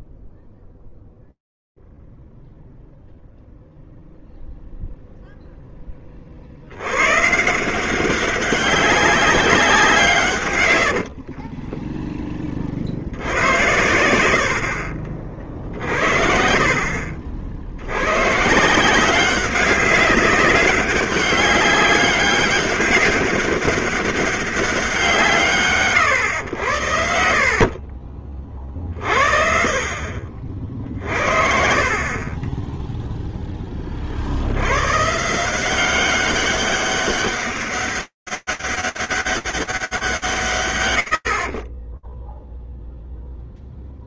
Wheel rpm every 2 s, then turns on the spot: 0, 0, 0, 10, 160, 180, 20, 80, 50, 70, 190, 200, 200, 140, 50, 60, 30, 80, 190, 200, 60, 0.
12-14